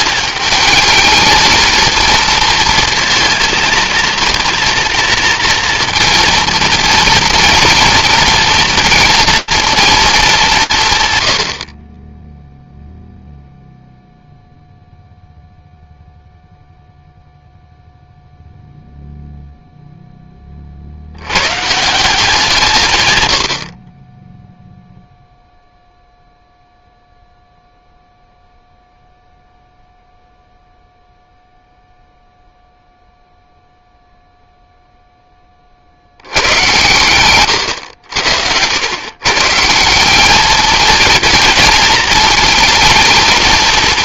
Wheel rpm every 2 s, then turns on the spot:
210, 230, 230, 230, 230, 190, 0, 0, 0, 0, 70, 130, 0, 0, 0, 0, 0, 0, 120, 110, 230, 230.
none